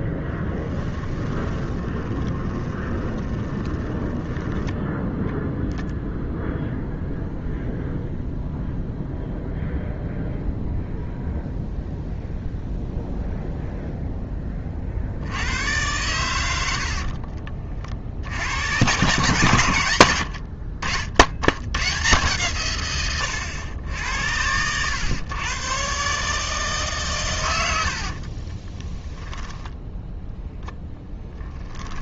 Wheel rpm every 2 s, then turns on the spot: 10, 20, 10, 0, 0, 0, 0, 30, 80, 90, 60, 120, 90, 150, 20, 0.
0-6 28-30